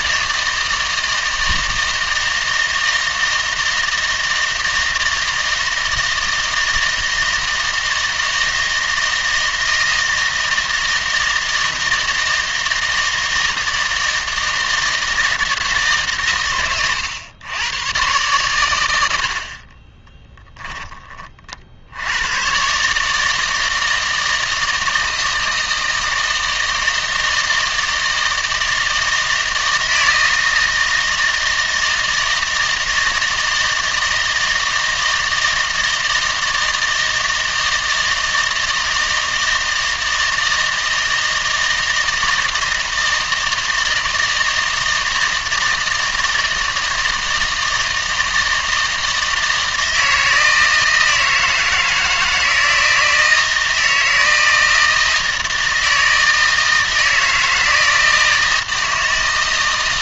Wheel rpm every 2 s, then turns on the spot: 160, 160, 160, 160, 160, 160, 160, 160, 110, 90, 10, 140, 160, 160, 160, 160, 160, 160, 160, 160, 160, 160, 160, 160, 160, 160, 160, 160, 160, 160.
none